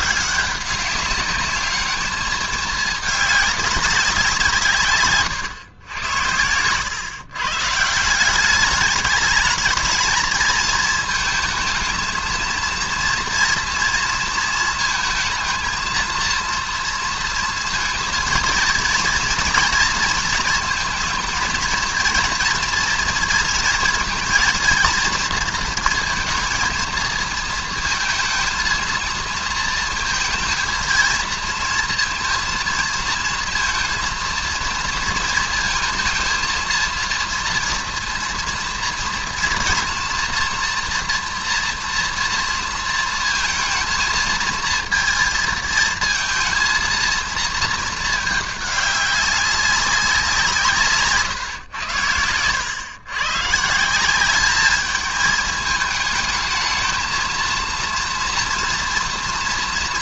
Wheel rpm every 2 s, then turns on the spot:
190, 210, 160, 100, 190, 220, 230, 230, 230, 230, 230, 240, 230, 230, 230, 220, 230, 230, 230, 240, 230, 230, 230, 230, 210, 170, 100, 200, 220, 230.
6-8